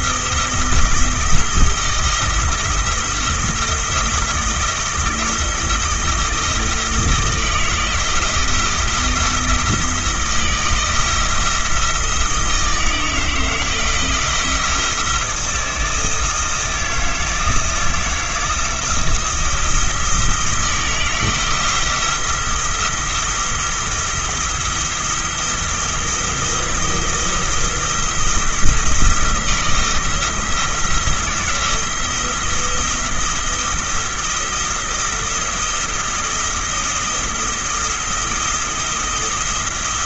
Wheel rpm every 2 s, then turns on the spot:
170, 170, 170, 160, 170, 170, 160, 170, 160, 160, 160, 170, 170, 170, 170, 170, 170, 170, 170, 170.
none